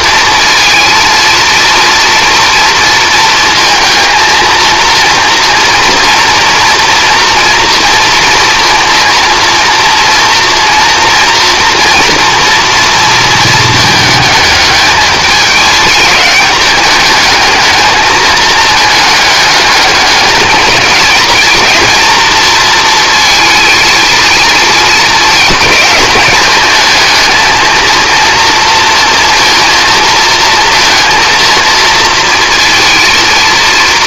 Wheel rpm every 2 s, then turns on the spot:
230, 230, 230, 230, 230, 230, 230, 210, 210, 220, 210, 230, 220, 220, 230, 230, 230.
none